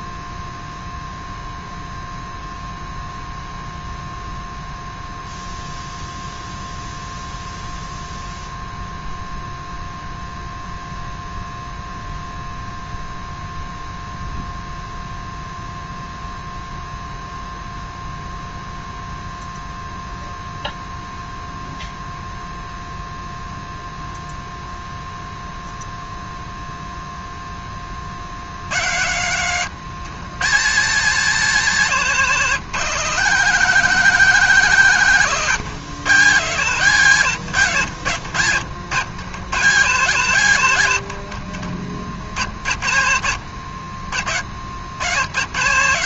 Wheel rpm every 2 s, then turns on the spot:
0, 0, 0, 0, 0, 0, 0, 0, 0, 0, 0, 0, 0, 0, 90, 130, 160, 140, 140, 90, 110, 70, 70.
42-44